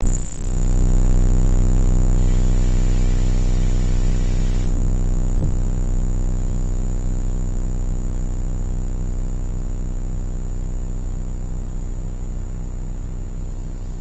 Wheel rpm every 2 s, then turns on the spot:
0, 0, 0, 0, 0, 0, 0.
none